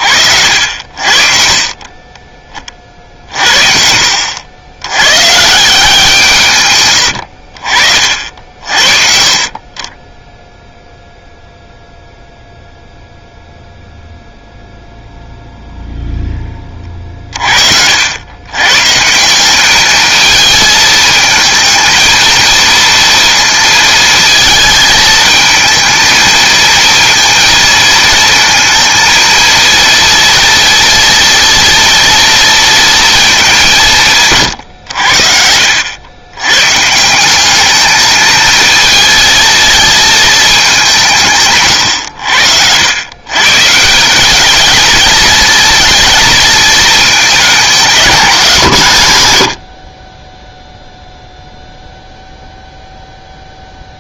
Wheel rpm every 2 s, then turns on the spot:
70, 30, 90, 120, 50, 0, 0, 0, 20, 130, 220, 230, 220, 230, 230, 230, 230, 120, 120, 220, 210, 90, 210, 230, 170, 0, 0.
34-36